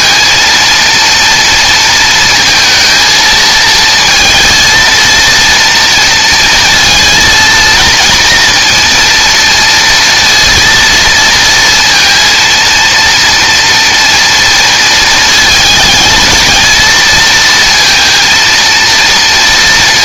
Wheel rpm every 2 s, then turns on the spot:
230, 230, 230, 230, 230, 230, 230, 220, 230, 230.
none